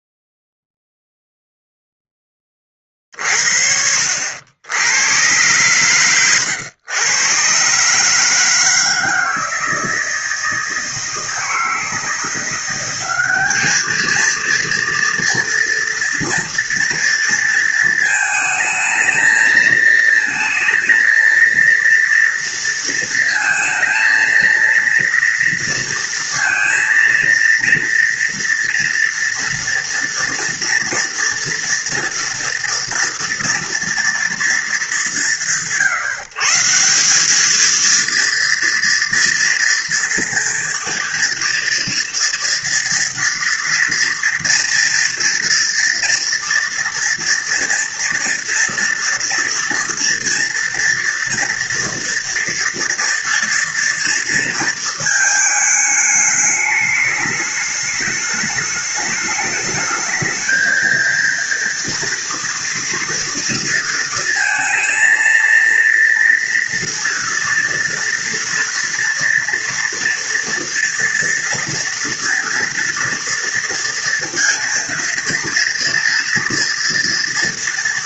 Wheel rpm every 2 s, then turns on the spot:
0, 30, 90, 100, 160, 160, 180, 230, 230, 220, 230, 230, 230, 230, 230, 230, 230, 180, 170, 230, 230, 230, 230, 230, 240, 230, 230, 230, 210, 210, 230, 240, 230, 240, 230, 230, 230, 230, 240.
none